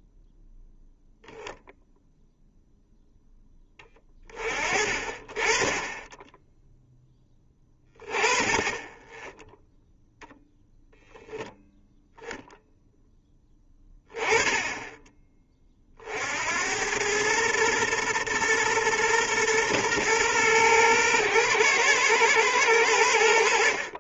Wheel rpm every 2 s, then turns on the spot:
0, 0, 40, 10, 10, 10, 0, 10, 90, 120, 110, 100.
none